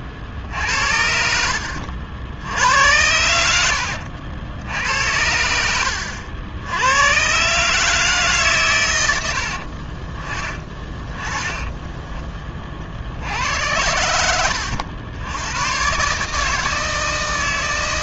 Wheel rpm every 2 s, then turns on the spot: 60, 80, 80, 90, 120, 20, 40, 80, 160.
none